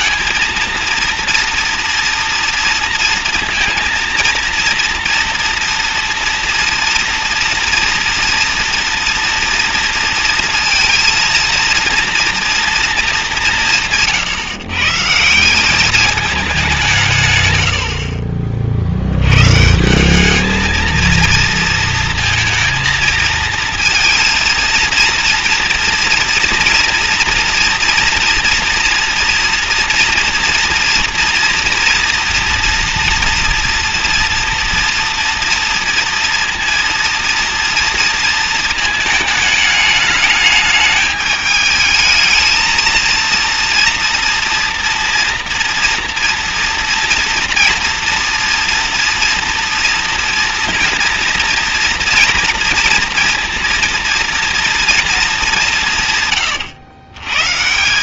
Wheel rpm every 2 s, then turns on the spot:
230, 230, 230, 230, 230, 230, 230, 140, 200, 50, 220, 220, 230, 230, 230, 230, 230, 230, 230, 230, 210, 220, 230, 230, 240, 230, 230, 230, 120.
none